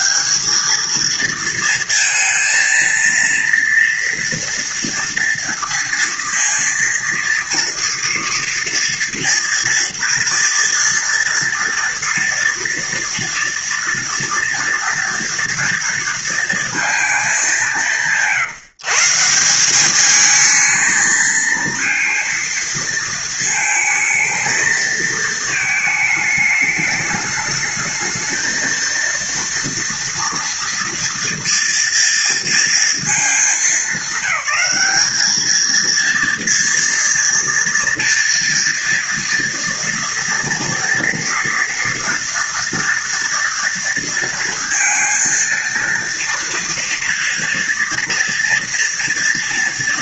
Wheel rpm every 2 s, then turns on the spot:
220, 230, 230, 230, 230, 230, 230, 230, 220, 160, 220, 230, 220, 210, 230, 230, 220, 200, 230, 230, 230, 230, 230, 230, 230.
none